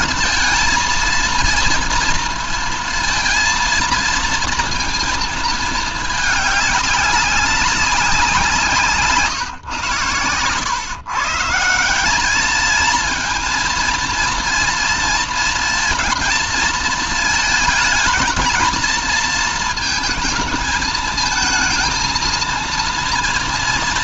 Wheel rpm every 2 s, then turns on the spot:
230, 230, 220, 200, 160, 130, 220, 230, 230, 230, 220, 230.
none